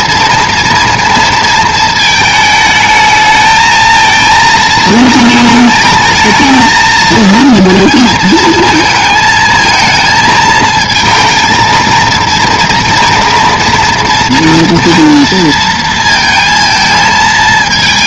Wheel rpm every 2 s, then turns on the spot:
230, 210, 220, 220, 230, 230, 230, 230, 230.
none